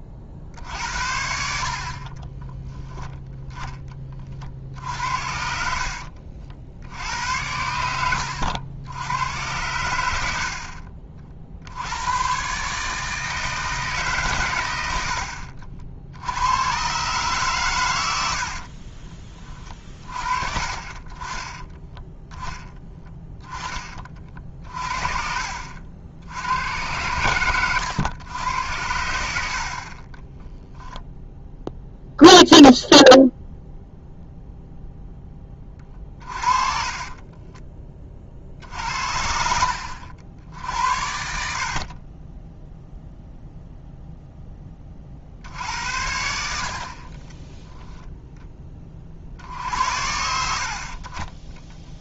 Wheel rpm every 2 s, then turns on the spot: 60, 10, 50, 70, 90, 60, 140, 100, 110, 50, 40, 10, 40, 90, 90, 0, 0, 0, 40, 50, 70, 10, 10, 60, 10, 70.
4-6 10-12 18-20 24-26 36-38